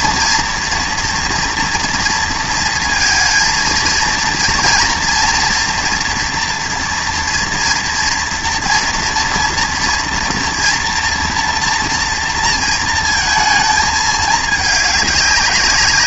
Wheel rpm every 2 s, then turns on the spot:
230, 230, 230, 230, 230, 230, 230, 210.
none